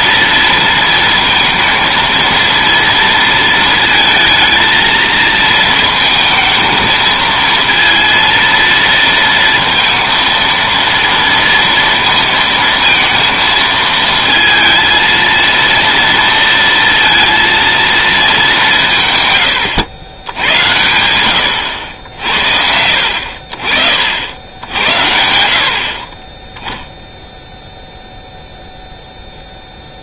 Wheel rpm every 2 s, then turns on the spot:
230, 230, 230, 220, 230, 230, 230, 230, 230, 180, 90, 60, 80, 10, 0.
none